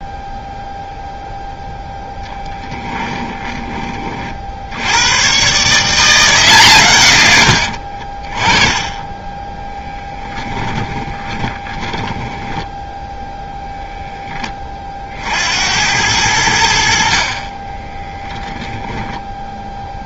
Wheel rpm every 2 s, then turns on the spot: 0, 10, 60, 150, 20, 10, 10, 20, 80, 0.
10-12